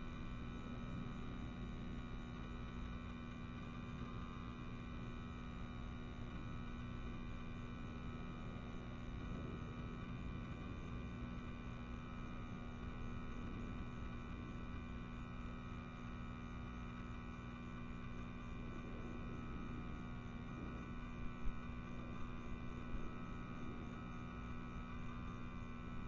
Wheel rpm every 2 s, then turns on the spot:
0, 0, 0, 0, 0, 0, 0, 0, 0, 0, 0, 0, 0.
none